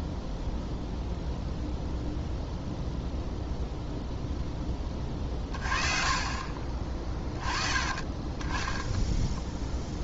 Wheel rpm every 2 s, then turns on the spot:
0, 0, 10, 30, 10.
none